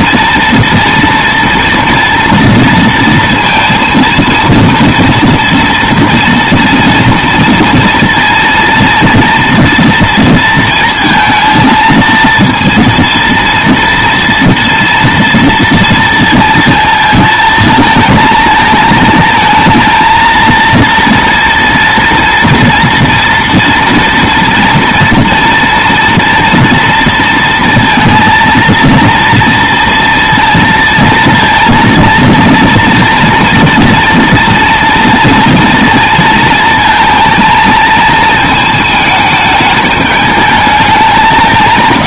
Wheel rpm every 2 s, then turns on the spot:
230, 230, 230, 230, 230, 230, 230, 230, 220, 220, 230, 230, 230, 230, 230, 230, 230, 230, 220, 220, 200.
none